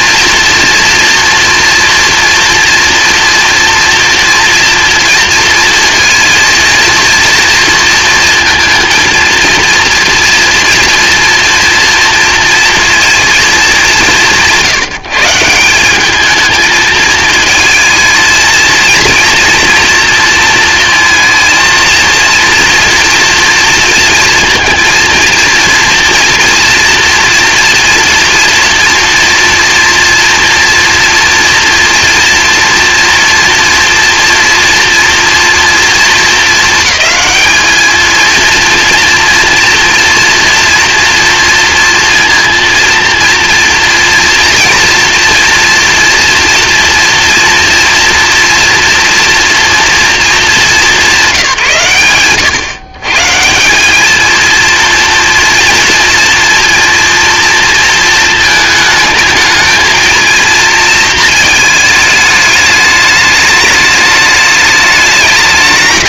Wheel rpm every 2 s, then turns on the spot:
230, 230, 230, 230, 230, 230, 230, 170, 220, 230, 230, 230, 230, 230, 230, 230, 230, 240, 220, 230, 240, 230, 230, 230, 230, 210, 120, 230, 240, 220, 230, 210, 210.
none